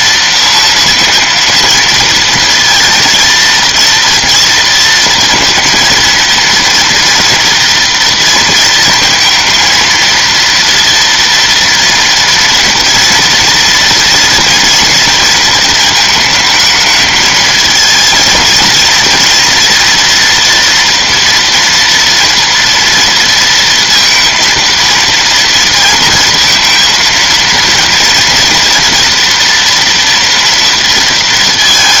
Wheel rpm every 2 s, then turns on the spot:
230, 230, 230, 230, 230, 230, 240, 230, 220, 240, 230, 230, 230, 230, 240, 220.
none